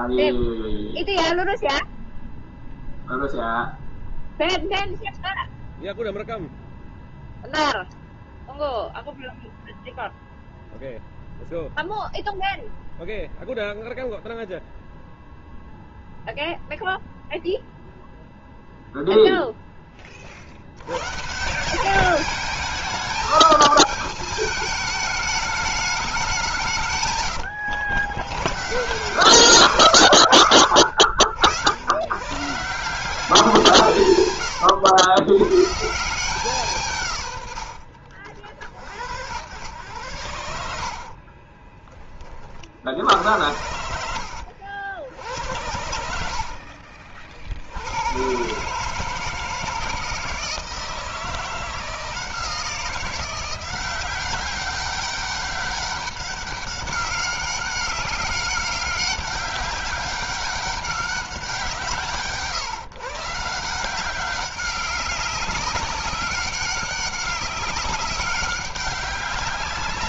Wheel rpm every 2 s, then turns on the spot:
0, 0, 0, 0, 0, 0, 0, 0, 0, 0, 110, 210, 210, 150, 130, 60, 170, 110, 150, 70, 60, 60, 80, 50, 150, 160, 170, 190, 200, 200, 200, 140, 190, 200, 200.
30-32